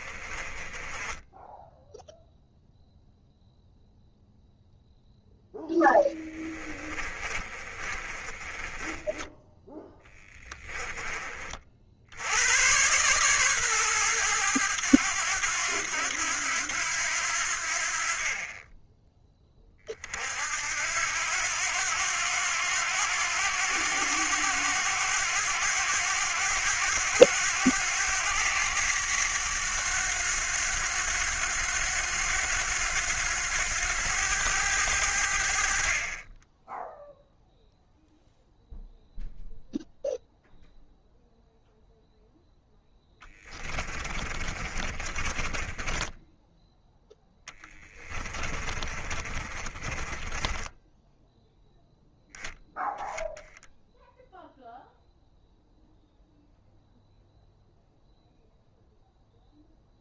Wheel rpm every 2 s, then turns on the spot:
20, 0, 0, 30, 20, 20, 120, 100, 90, 10, 80, 90, 100, 100, 100, 90, 90, 90, 0, 0, 0, 10, 30, 0, 30, 10, 0, 0, 0, 0.
0-2 6-10 42-46 48-52